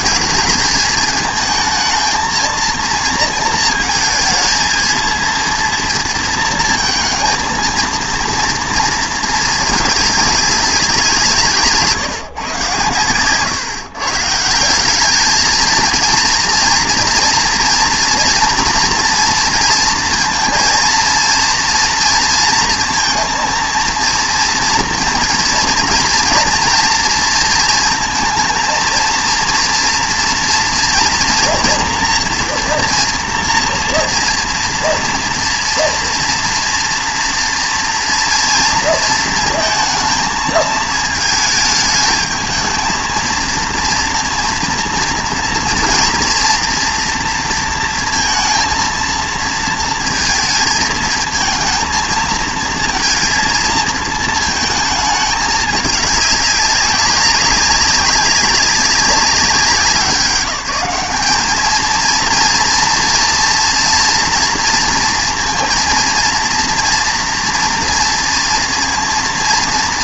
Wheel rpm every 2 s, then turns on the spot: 220, 230, 230, 230, 230, 190, 130, 170, 230, 230, 230, 230, 230, 230, 230, 240, 240, 230, 230, 230, 220, 220, 230, 230, 230, 220, 230, 220, 190, 190, 180, 230, 230, 230, 230.
none